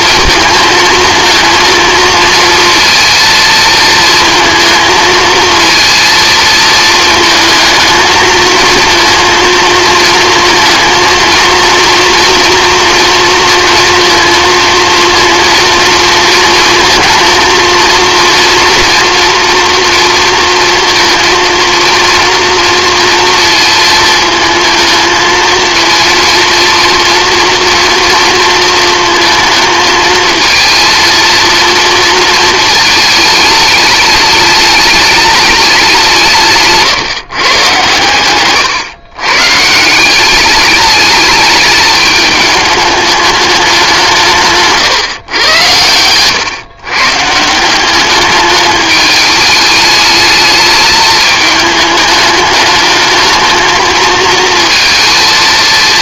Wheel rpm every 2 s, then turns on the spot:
220, 230, 220, 220, 230, 230, 230, 230, 230, 240, 230, 240, 230, 230, 220, 230, 220, 210, 150, 120, 210, 210, 150, 130, 210, 220, 210, 230.
none